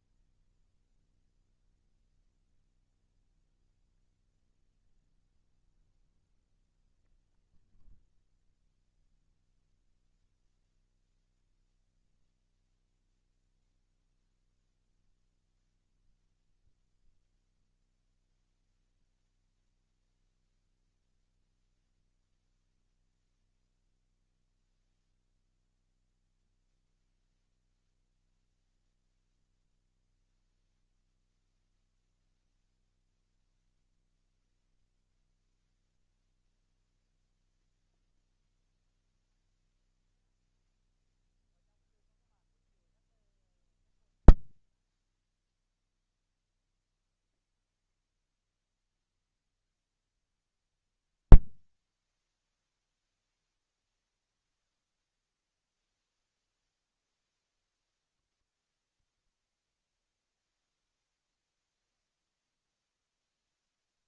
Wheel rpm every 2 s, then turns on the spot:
0, 0, 0, 0, 0, 0, 0, 0, 0, 0, 0, 0, 0, 0, 0, 0, 0, 0, 0, 0, 0, 0, 0, 0, 0, 0, 0, 0, 0, 0, 0, 0.
none